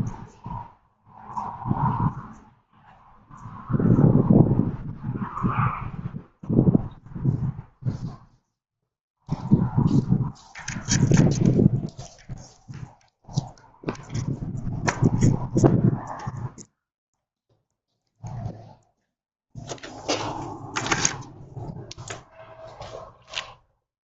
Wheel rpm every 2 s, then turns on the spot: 0, 0, 0, 0, 0, 0, 0, 0, 0, 0, 0, 0.
none